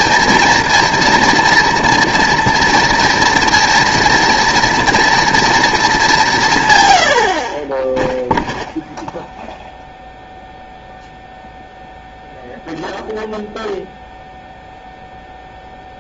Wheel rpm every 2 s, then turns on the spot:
230, 230, 230, 130, 0, 0, 0, 0.
none